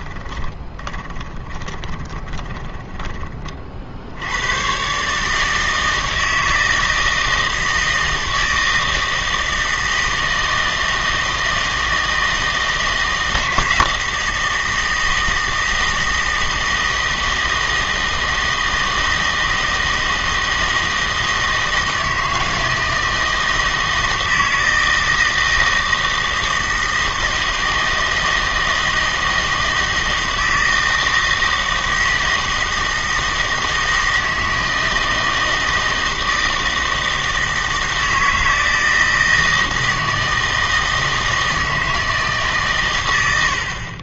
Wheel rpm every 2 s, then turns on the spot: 20, 20, 120, 160, 160, 160, 160, 160, 160, 160, 160, 160, 160, 160, 160, 160, 160, 160, 160, 160, 160, 130.
0-4